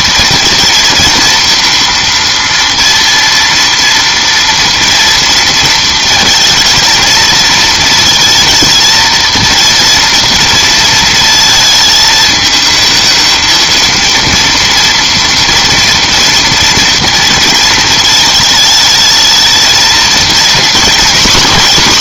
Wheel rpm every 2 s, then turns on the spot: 230, 230, 230, 220, 230, 230, 220, 230, 230, 220, 230.
none